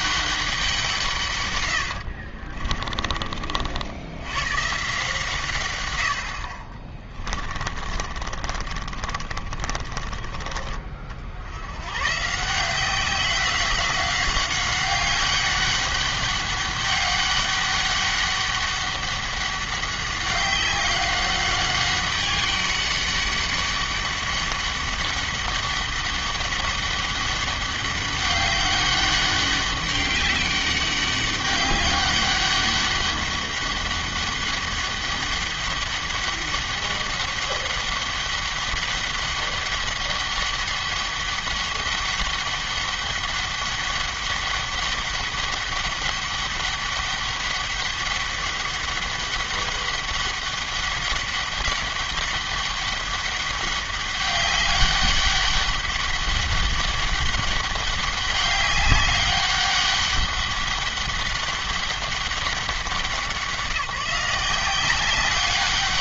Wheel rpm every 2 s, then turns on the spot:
170, 40, 150, 40, 40, 40, 180, 190, 200, 200, 190, 200, 200, 200, 200, 200, 200, 200, 200, 200, 200, 200, 200, 200, 200, 200, 200, 200, 200, 200, 200, 190, 190.
2-4 6-10